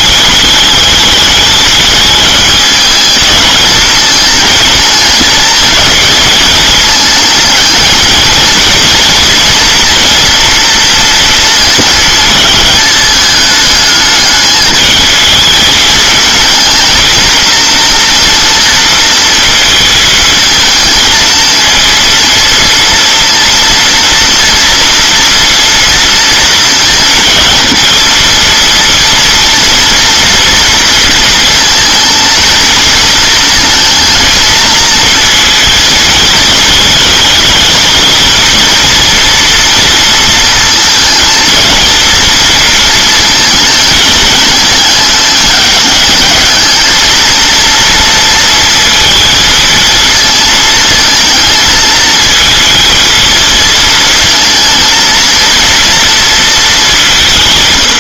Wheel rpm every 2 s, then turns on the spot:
210, 220, 230, 220, 230, 230, 220, 220, 230, 230, 220, 230, 230, 230, 230, 230, 230, 230, 220, 230, 230, 230, 210, 220, 230, 220, 220, 230, 200.
none